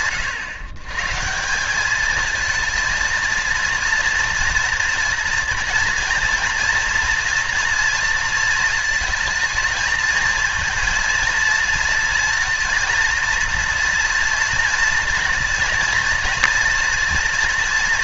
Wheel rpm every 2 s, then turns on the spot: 120, 230, 230, 230, 220, 230, 230, 230, 230.
none